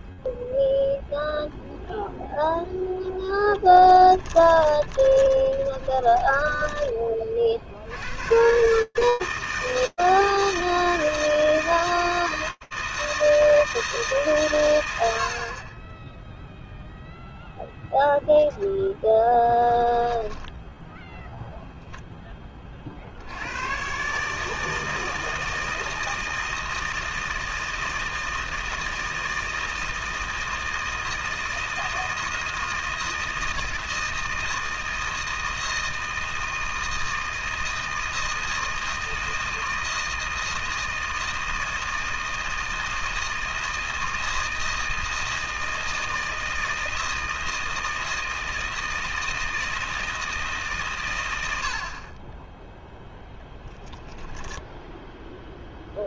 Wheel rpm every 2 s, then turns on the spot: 0, 0, 20, 30, 160, 160, 160, 140, 0, 0, 0, 90, 160, 160, 160, 160, 160, 160, 160, 160, 160, 160, 160, 160, 160, 100, 0, 0.
4-6